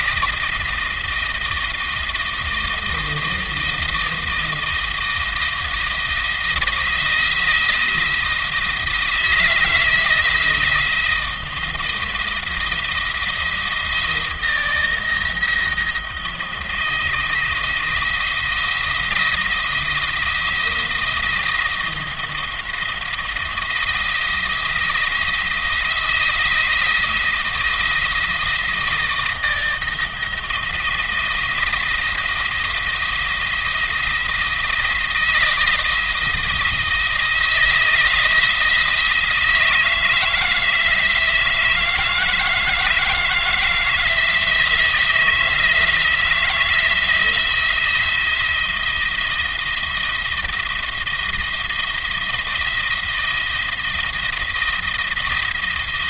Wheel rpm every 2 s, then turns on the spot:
170, 170, 170, 170, 160, 170, 170, 170, 170, 170, 170, 170, 170, 170, 160, 170, 170, 170, 160, 160, 160, 160, 160, 170, 170, 170, 170, 170.
none